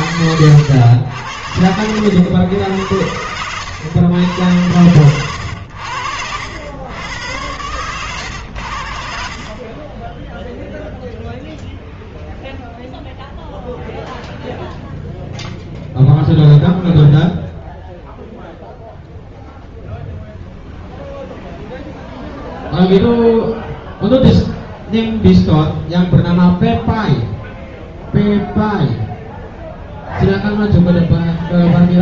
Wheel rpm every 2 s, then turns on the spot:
90, 100, 90, 90, 90, 10, 0, 0, 0, 0, 0, 0, 0, 0, 0, 0.
none